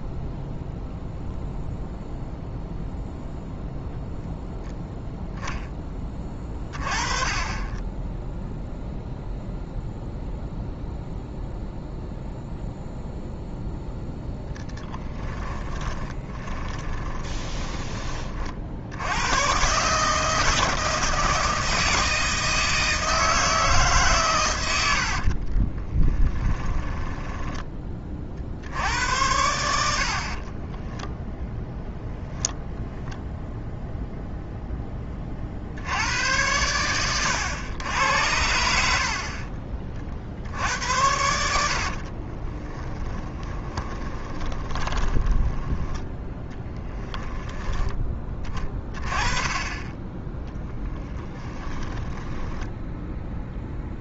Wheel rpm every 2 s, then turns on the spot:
0, 0, 0, 30, 0, 0, 0, 10, 20, 80, 160, 160, 80, 10, 80, 10, 0, 20, 100, 70, 70, 20, 30, 10, 20, 10, 10.
14-18 24-28 30-32 42-46 50-54